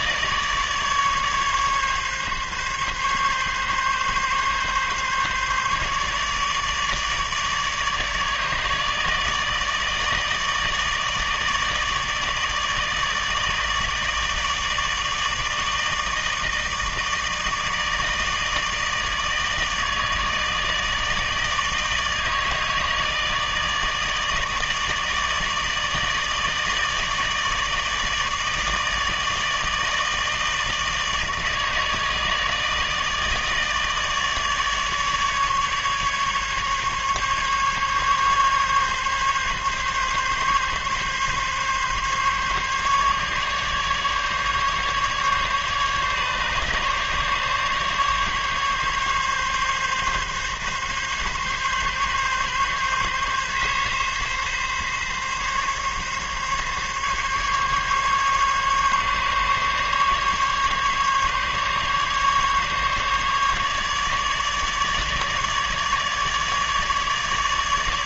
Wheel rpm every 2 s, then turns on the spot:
150, 140, 140, 150, 150, 160, 150, 160, 160, 150, 150, 150, 150, 150, 150, 160, 160, 150, 140, 140, 140, 140, 150, 140, 140, 140, 140, 140, 140, 140, 140, 140, 150, 150.
none